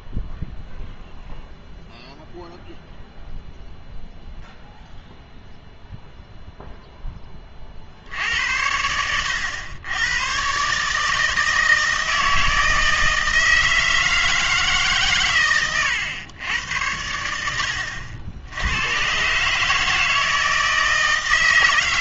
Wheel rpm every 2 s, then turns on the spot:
0, 0, 0, 0, 90, 140, 160, 150, 90, 100, 160.
none